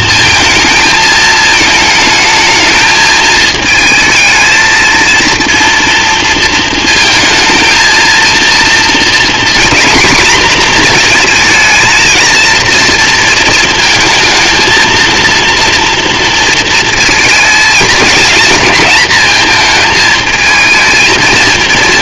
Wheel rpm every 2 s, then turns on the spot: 230, 220, 220, 220, 230, 230, 230, 220, 230, 220, 220.
none